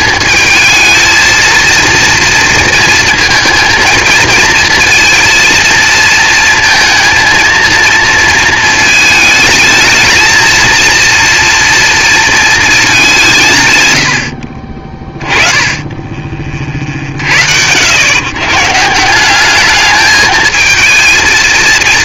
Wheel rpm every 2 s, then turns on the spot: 220, 230, 230, 230, 220, 220, 220, 50, 30, 130, 220.
none